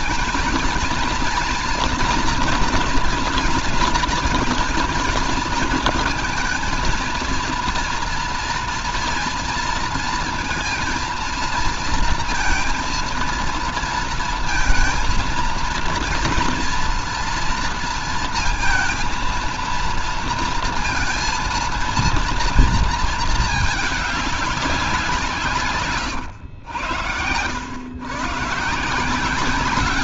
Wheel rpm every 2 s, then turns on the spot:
230, 230, 230, 230, 230, 230, 230, 230, 230, 230, 230, 230, 200, 100, 130.
none